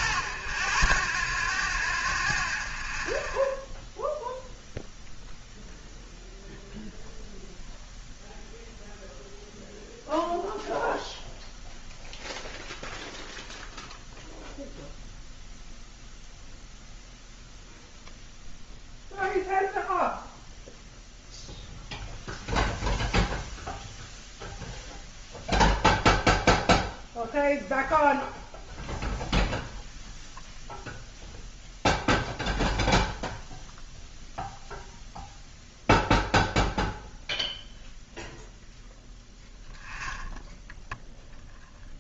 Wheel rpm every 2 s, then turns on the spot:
0, 0, 0, 0, 0, 0, 0, 0, 0, 0, 0, 0, 0, 0, 0, 0, 0, 0, 0, 0, 0.
none